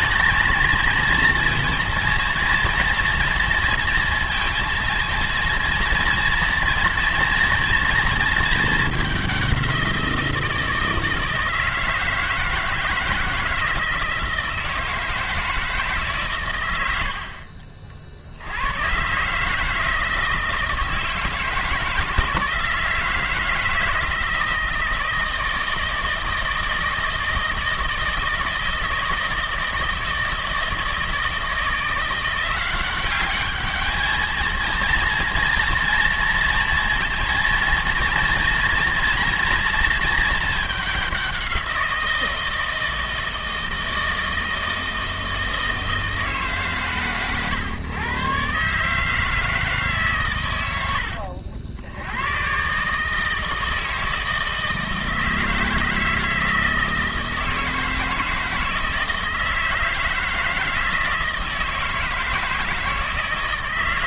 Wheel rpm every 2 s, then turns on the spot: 220, 230, 230, 230, 210, 170, 160, 160, 90, 110, 160, 160, 160, 160, 160, 160, 180, 230, 230, 230, 210, 160, 160, 140, 150, 90, 130, 160, 160, 160, 160, 160.
none